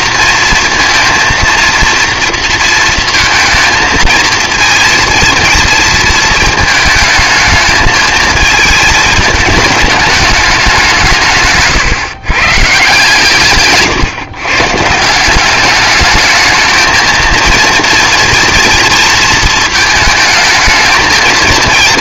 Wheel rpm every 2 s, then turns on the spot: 230, 230, 230, 220, 210, 160, 150, 180, 230, 230, 220.
none